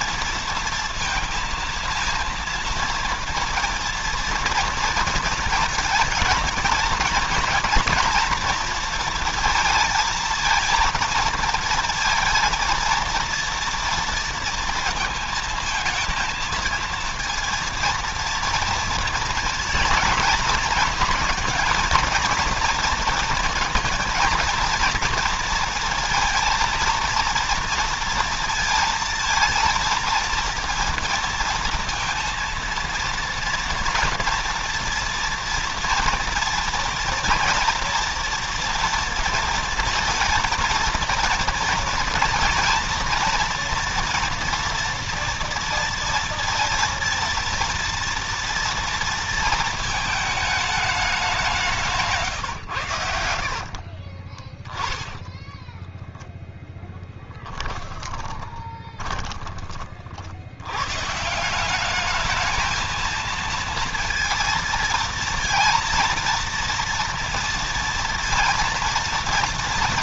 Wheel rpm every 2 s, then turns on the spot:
230, 230, 230, 230, 230, 220, 230, 230, 220, 230, 230, 230, 230, 230, 230, 230, 230, 230, 240, 230, 230, 230, 230, 230, 230, 210, 130, 30, 0, 20, 90, 220, 230, 230, 230.
54-56 58-60